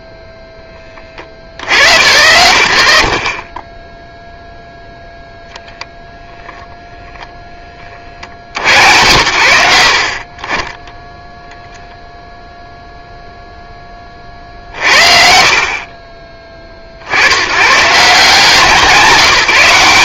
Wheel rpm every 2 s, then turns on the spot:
0, 80, 0, 0, 100, 10, 0, 60, 40, 170.
none